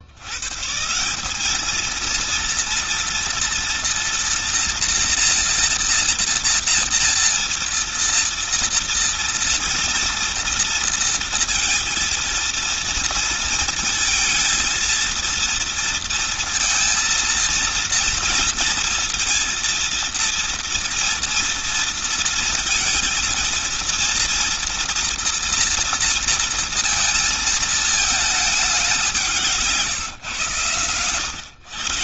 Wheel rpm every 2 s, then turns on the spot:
140, 230, 240, 230, 230, 230, 230, 230, 230, 230, 230, 230, 230, 230, 200, 120.
none